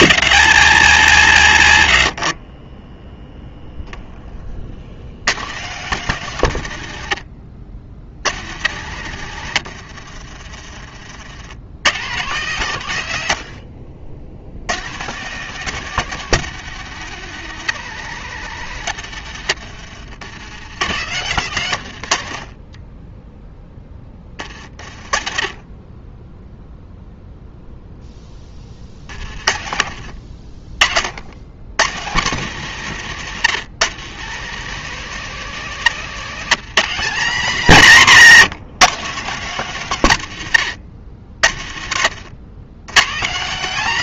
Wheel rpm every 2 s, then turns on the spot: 100, 10, 60, 90, 90, 40, 110, 110, 150, 120, 90, 10, 20, 0, 40, 50, 170, 200, 180, 170, 100, 130.
20-24 28-30